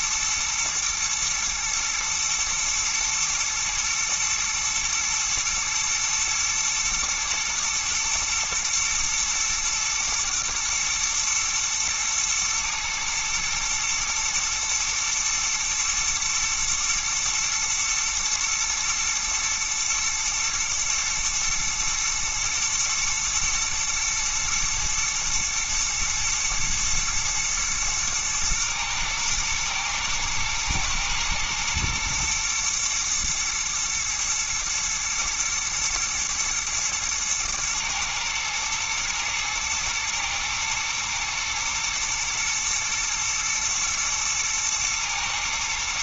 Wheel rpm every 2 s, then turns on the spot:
110, 120, 120, 110, 110, 120, 110, 120, 110, 110, 120, 120, 120, 120, 120, 120, 120, 110, 110, 110, 110, 120, 110.
none